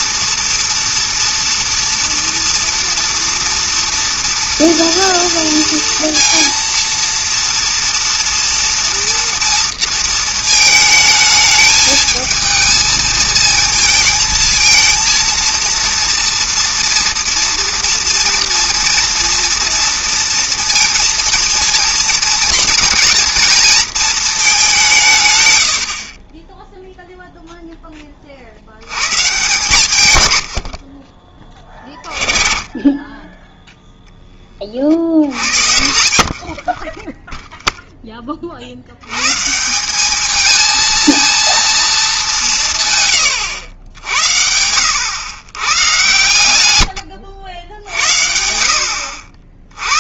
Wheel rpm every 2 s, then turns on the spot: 230, 230, 230, 230, 230, 220, 220, 230, 230, 230, 230, 230, 200, 10, 70, 90, 20, 30, 50, 60, 220, 170, 80, 110, 70.
36-38